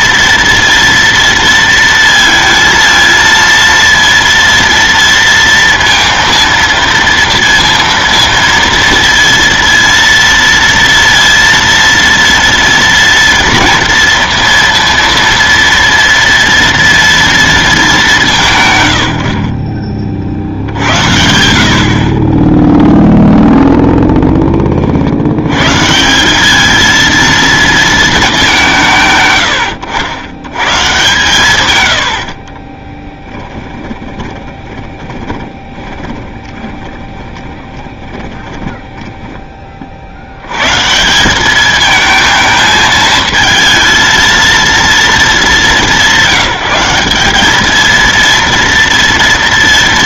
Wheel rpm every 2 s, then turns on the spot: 230, 230, 230, 230, 230, 230, 230, 230, 230, 130, 70, 10, 20, 210, 190, 130, 40, 20, 20, 10, 110, 220, 230, 200, 230.
32-40